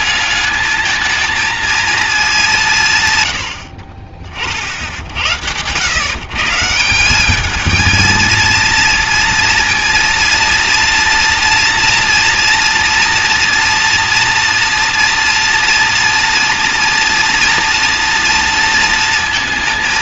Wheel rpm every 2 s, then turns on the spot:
210, 190, 60, 160, 230, 240, 240, 230, 230, 230.
none